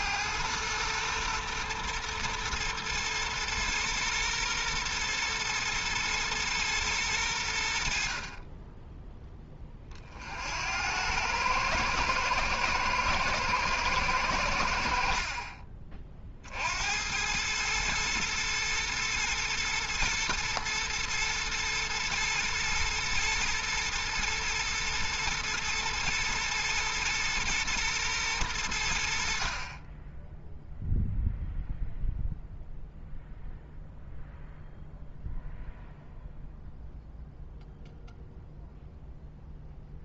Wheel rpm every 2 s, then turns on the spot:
120, 110, 120, 110, 20, 70, 110, 70, 70, 120, 120, 110, 120, 110, 100, 0, 0, 0, 0, 0.
none